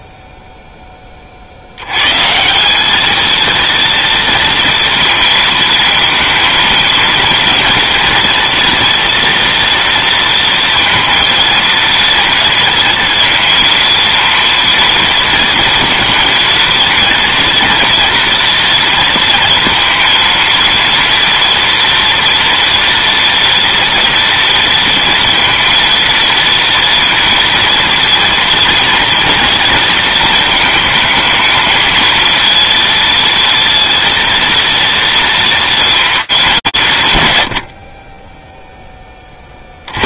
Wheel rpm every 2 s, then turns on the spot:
10, 190, 230, 230, 240, 230, 230, 230, 230, 230, 230, 240, 230, 230, 230, 230, 230, 230, 190, 10.
none